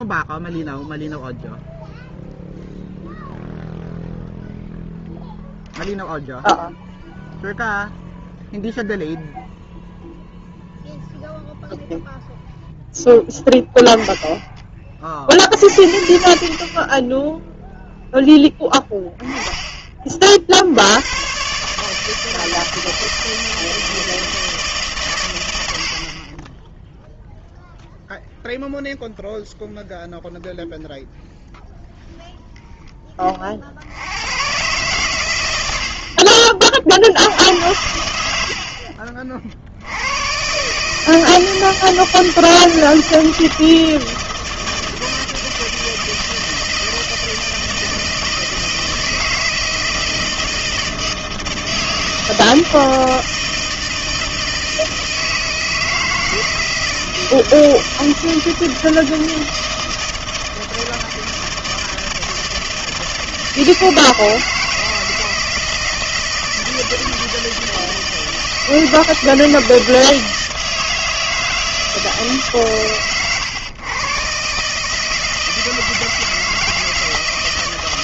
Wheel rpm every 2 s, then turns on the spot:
0, 0, 0, 0, 0, 0, 10, 30, 40, 10, 70, 160, 150, 20, 0, 0, 0, 110, 40, 80, 130, 160, 160, 160, 160, 160, 160, 160, 160, 160, 160, 160, 160, 160, 160, 160, 140, 140, 160.
none